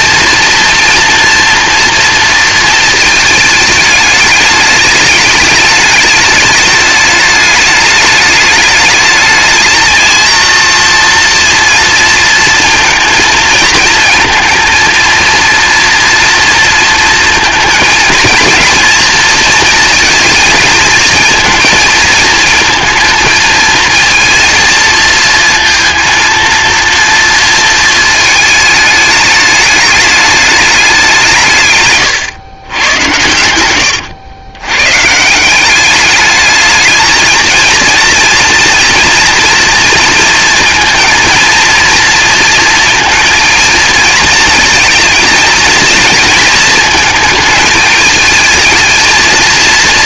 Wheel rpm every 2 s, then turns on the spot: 230, 230, 210, 210, 210, 230, 230, 230, 230, 230, 220, 230, 230, 230, 220, 210, 110, 130, 220, 230, 230, 230, 230, 220, 220.
none